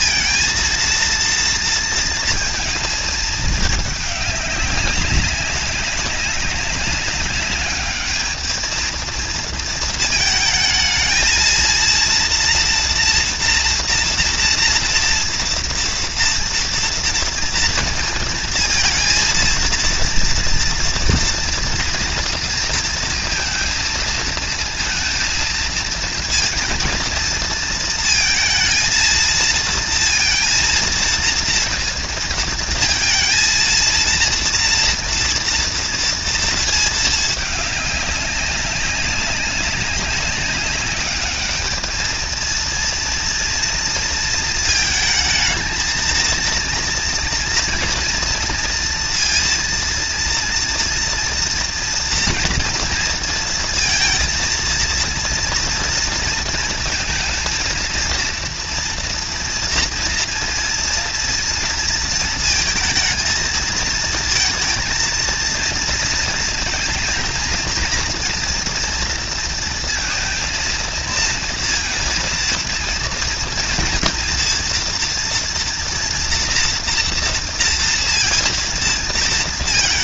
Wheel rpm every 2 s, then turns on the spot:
230, 220, 200, 190, 220, 220, 240, 230, 230, 230, 230, 230, 230, 230, 220, 230, 230, 230, 220, 200, 200, 230, 220, 230, 240, 230, 230, 230, 230, 230, 230, 230, 230, 230, 240, 230, 230, 240, 230, 230.
none